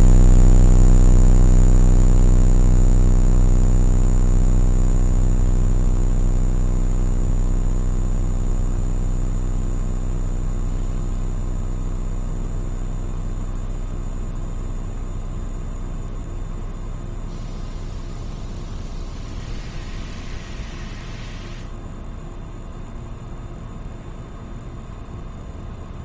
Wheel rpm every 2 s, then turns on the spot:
0, 0, 0, 0, 0, 0, 0, 0, 0, 0, 0, 0, 0.
none